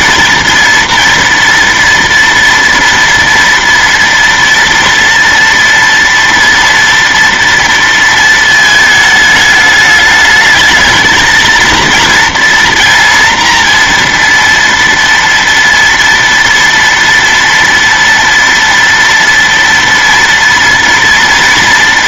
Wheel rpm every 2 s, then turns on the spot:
240, 230, 230, 230, 220, 220, 230, 230, 230, 230, 230.
none